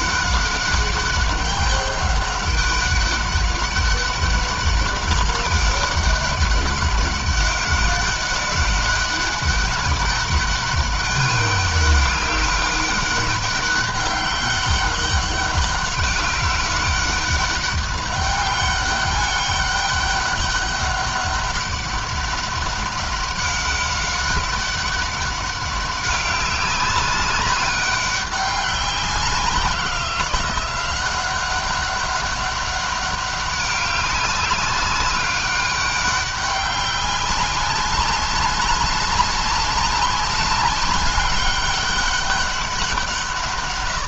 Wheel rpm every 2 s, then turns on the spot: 200, 200, 200, 200, 200, 200, 200, 200, 200, 200, 200, 200, 200, 190, 190, 180, 200, 190, 200, 200, 200, 180.
none